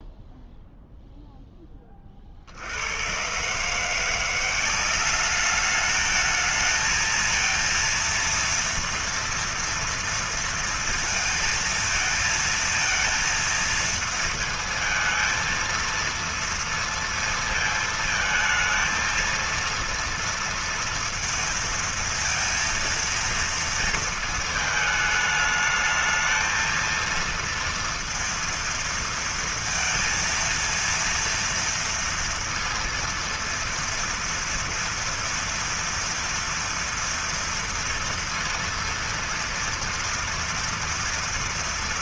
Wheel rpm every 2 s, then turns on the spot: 0, 50, 180, 220, 230, 230, 230, 230, 230, 220, 230, 230, 220, 220, 230, 230, 230, 230, 230, 230, 240.
none